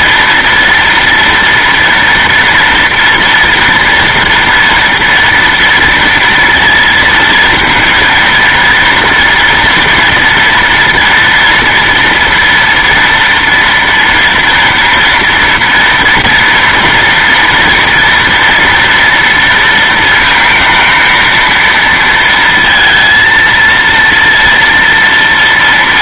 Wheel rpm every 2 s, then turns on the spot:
230, 240, 240, 230, 230, 230, 230, 230, 230, 230, 230, 230, 230.
none